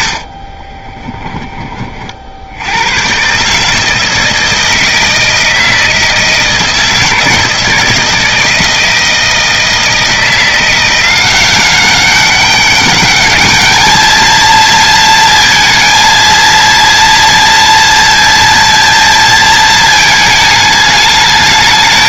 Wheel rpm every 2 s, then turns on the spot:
20, 100, 160, 160, 160, 170, 200, 230, 230, 230, 210.
0-2